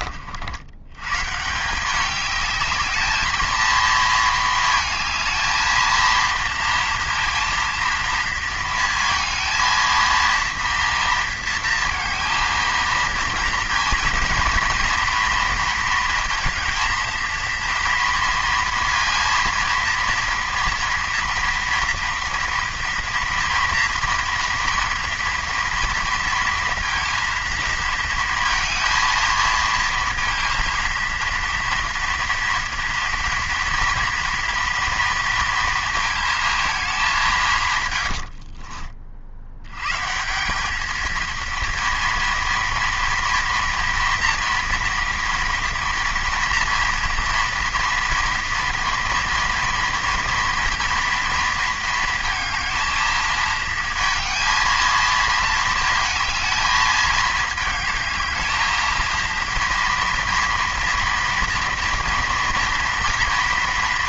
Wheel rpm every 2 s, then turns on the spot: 130, 220, 220, 230, 230, 230, 230, 230, 230, 230, 240, 230, 230, 230, 220, 230, 230, 230, 190, 50, 220, 240, 240, 230, 230, 230, 220, 220, 220, 230, 230, 230.
none